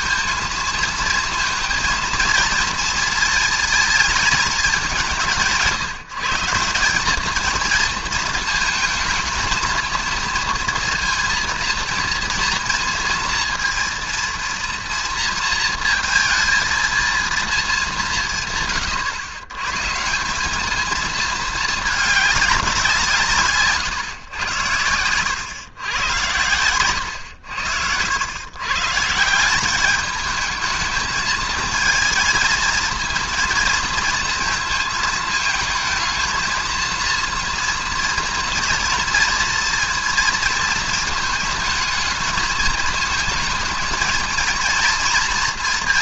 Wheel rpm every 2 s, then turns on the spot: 230, 230, 200, 180, 220, 230, 230, 240, 230, 140, 210, 190, 110, 110, 130, 220, 230, 220, 230, 230, 230, 220, 230.
none